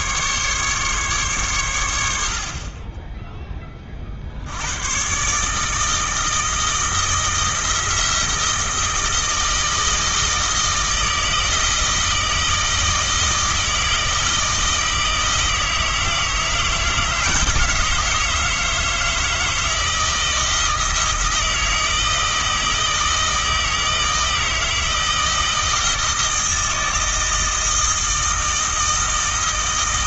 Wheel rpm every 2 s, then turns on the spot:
140, 30, 90, 160, 160, 160, 160, 160, 160, 160, 160, 160, 160, 160, 160.
none